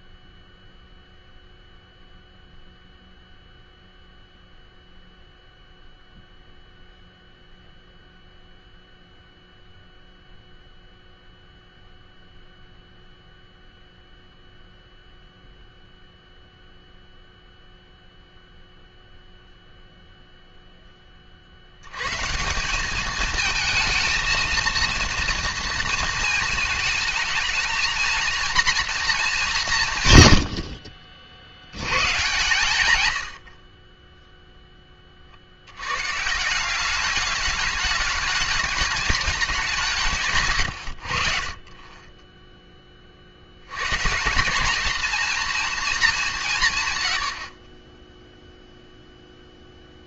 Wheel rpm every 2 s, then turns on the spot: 0, 0, 0, 0, 0, 0, 0, 0, 0, 0, 0, 180, 230, 220, 230, 70, 130, 10, 170, 210, 130, 10, 200, 150, 0.
none